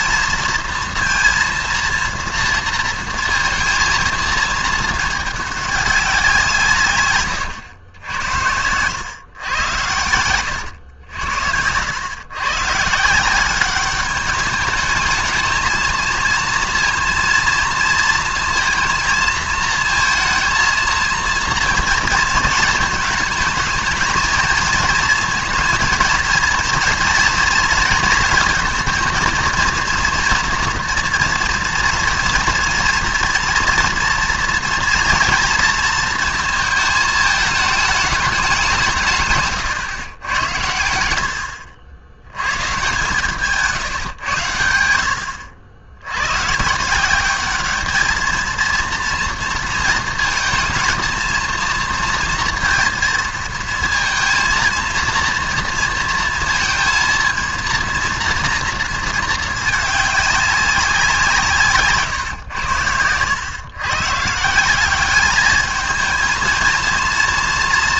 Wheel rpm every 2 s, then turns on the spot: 230, 230, 220, 150, 100, 90, 150, 210, 230, 230, 230, 220, 230, 230, 230, 230, 230, 230, 220, 160, 80, 140, 80, 170, 230, 230, 230, 230, 230, 230, 190, 100, 190, 230.
10-12